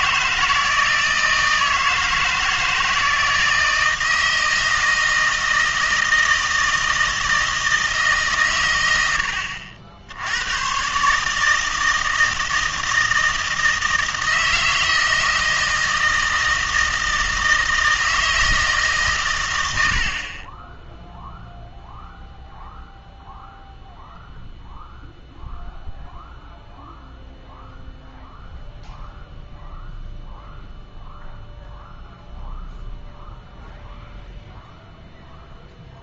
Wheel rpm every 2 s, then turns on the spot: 160, 160, 160, 160, 110, 110, 160, 160, 160, 160, 20, 0, 0, 0, 0, 0, 0, 0.
none